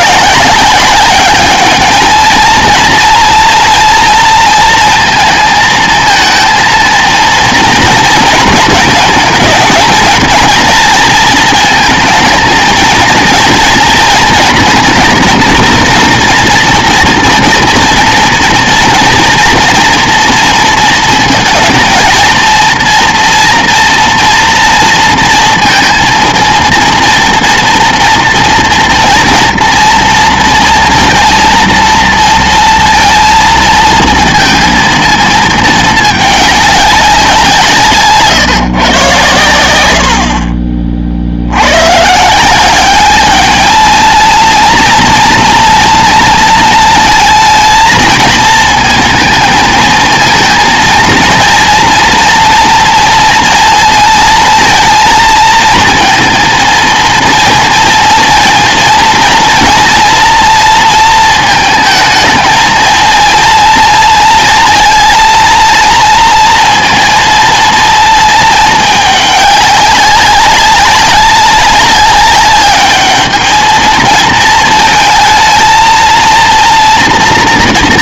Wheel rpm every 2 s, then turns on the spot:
200, 230, 230, 230, 220, 230, 220, 230, 220, 230, 230, 230, 240, 230, 230, 230, 230, 230, 200, 130, 40, 190, 230, 230, 220, 230, 230, 230, 230, 230, 230, 220, 230, 230, 210, 200, 210, 220, 230.
none